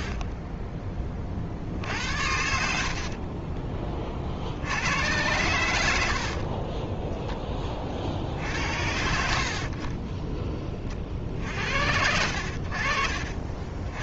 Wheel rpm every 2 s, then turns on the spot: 20, 60, 90, 20, 60, 40, 60.
2-4 6-8 12-14